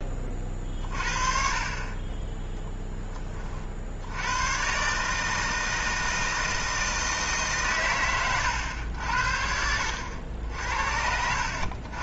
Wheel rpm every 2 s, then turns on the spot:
40, 10, 120, 160, 110, 70.
none